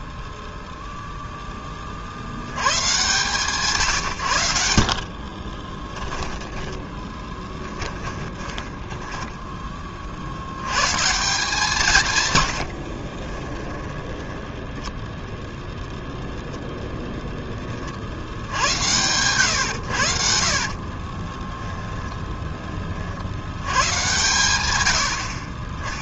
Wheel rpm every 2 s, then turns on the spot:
0, 120, 70, 10, 10, 140, 50, 0, 0, 100, 40, 30, 110.
4-8 12-14 20-22